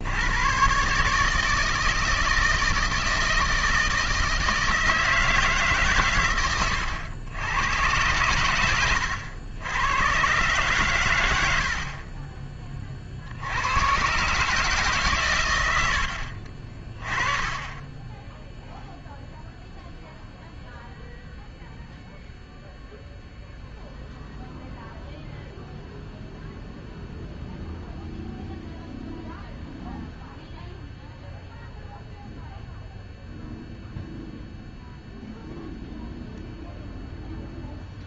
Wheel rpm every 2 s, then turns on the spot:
130, 160, 160, 110, 100, 130, 30, 150, 40, 0, 0, 0, 0, 0, 0, 0, 0, 0, 0.
none